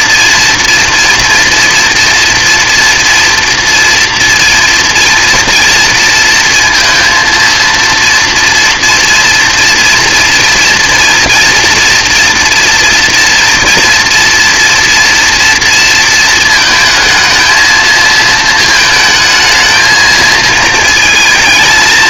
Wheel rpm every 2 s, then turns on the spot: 240, 230, 230, 230, 230, 230, 230, 230, 220, 220, 220.
none